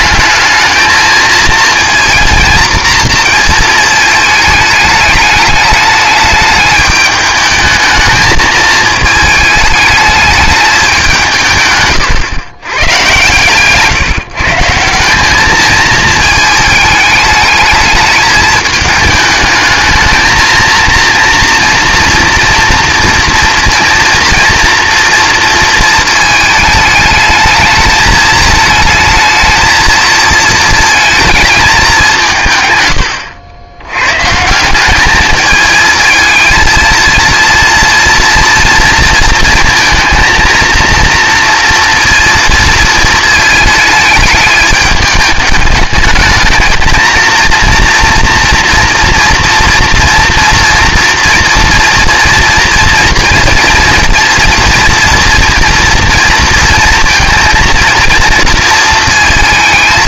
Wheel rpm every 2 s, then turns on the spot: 220, 230, 210, 210, 220, 210, 130, 160, 220, 220, 230, 230, 230, 210, 220, 230, 130, 180, 220, 230, 230, 230, 210, 220, 230, 230, 230, 230, 230, 220.
none